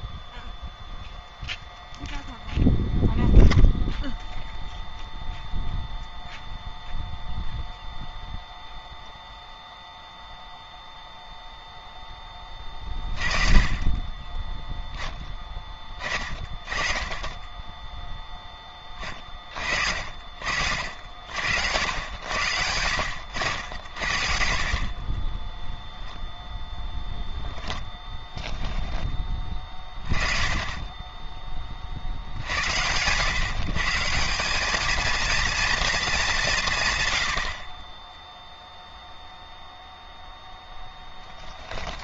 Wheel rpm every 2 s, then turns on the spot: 0, 0, 0, 0, 0, 20, 10, 30, 10, 40, 80, 80, 20, 10, 10, 20, 110, 220, 120, 0, 10.
none